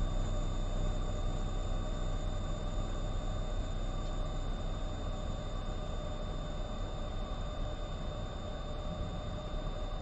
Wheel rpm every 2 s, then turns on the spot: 0, 0, 0, 0, 0.
none